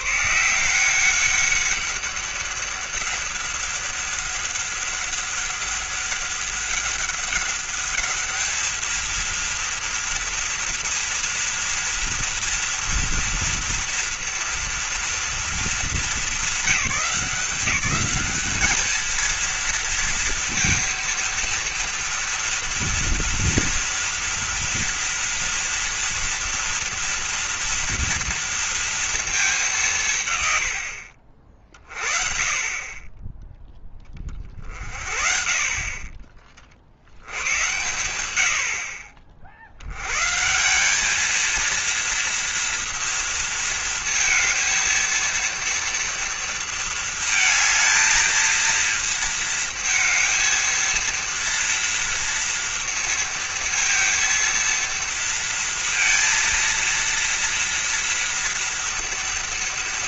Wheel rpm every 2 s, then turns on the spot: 170, 200, 200, 200, 220, 230, 230, 230, 210, 220, 230, 230, 230, 230, 230, 90, 40, 40, 40, 70, 180, 230, 220, 220, 230, 230, 230, 230, 230, 230.
none